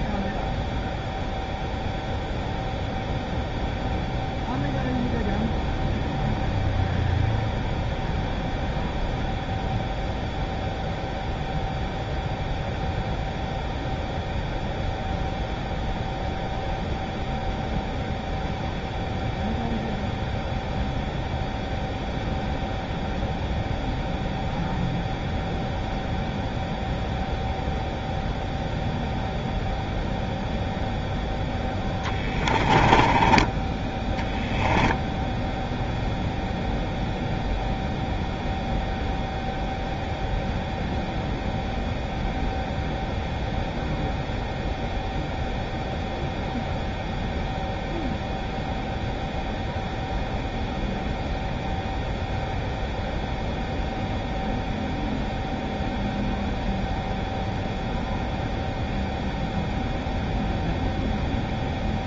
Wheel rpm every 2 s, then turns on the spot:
0, 0, 0, 0, 0, 0, 0, 0, 0, 0, 0, 0, 0, 0, 0, 0, 10, 0, 0, 0, 0, 0, 0, 0, 0, 0, 0, 0, 0, 0, 0.
32-34